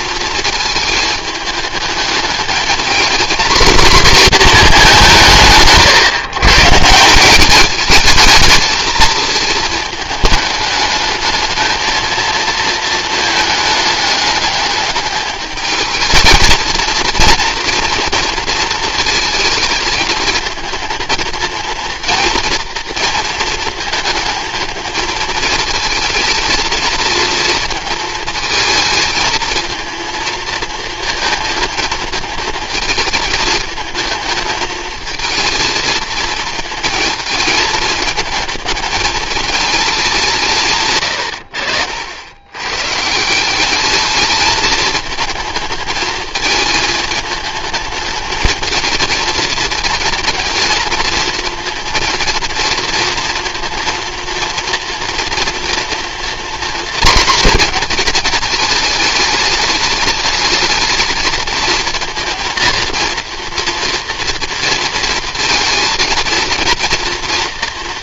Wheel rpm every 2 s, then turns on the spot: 220, 220, 200, 150, 220, 210, 230, 210, 230, 220, 230, 230, 220, 230, 220, 230, 220, 220, 220, 220, 120, 150, 220, 220, 220, 230, 230, 240, 240, 210, 220, 230, 230, 230.
none